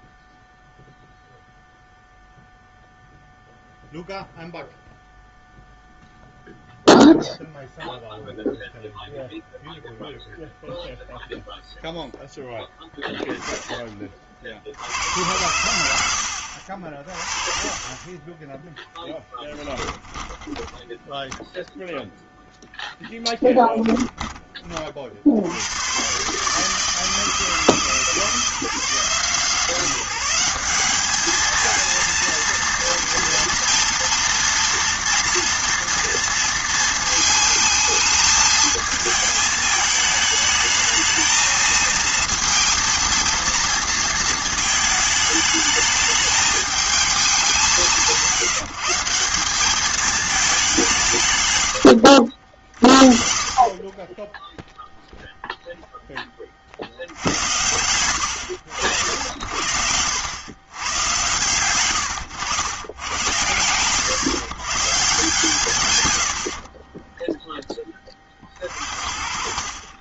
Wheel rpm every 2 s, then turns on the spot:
0, 0, 0, 0, 0, 0, 10, 70, 50, 10, 10, 0, 30, 150, 150, 190, 230, 230, 230, 220, 220, 230, 220, 210, 170, 190, 50, 0, 70, 90, 90, 100, 140, 30, 40.
20-22